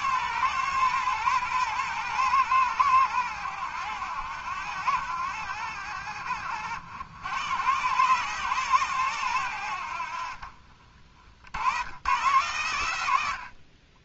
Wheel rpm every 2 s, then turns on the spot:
120, 110, 80, 80, 130, 40, 100.
none